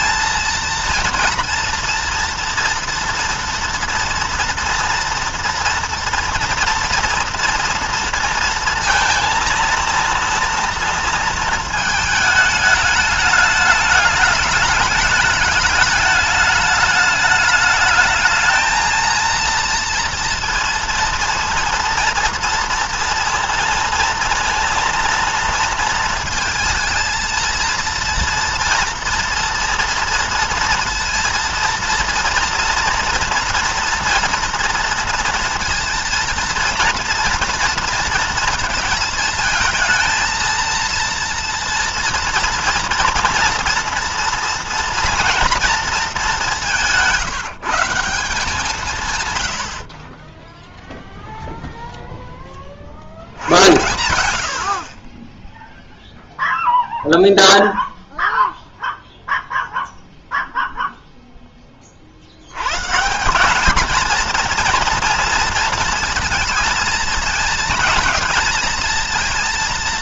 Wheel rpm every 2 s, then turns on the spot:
230, 230, 230, 240, 230, 230, 210, 210, 210, 220, 230, 230, 230, 230, 230, 230, 240, 230, 230, 230, 230, 230, 230, 200, 180, 10, 20, 90, 0, 0, 0, 100, 230, 230, 220.
none